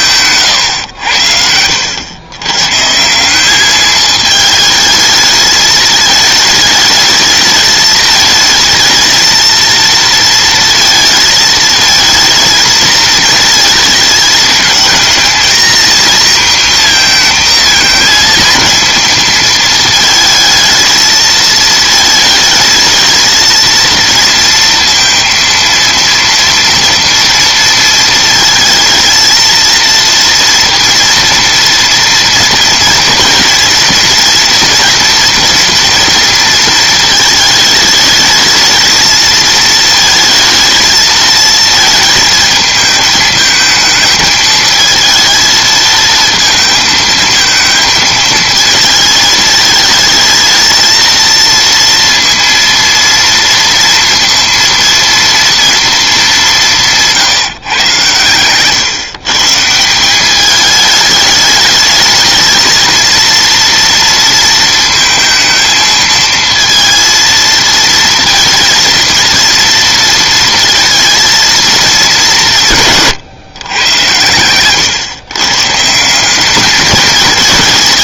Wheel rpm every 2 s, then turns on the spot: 130, 140, 220, 210, 220, 230, 220, 220, 230, 230, 220, 220, 230, 230, 220, 240, 230, 230, 230, 220, 220, 220, 220, 220, 220, 220, 230, 230, 200, 130, 210, 220, 230, 230, 230, 230, 170, 110, 210.
0-2 74-76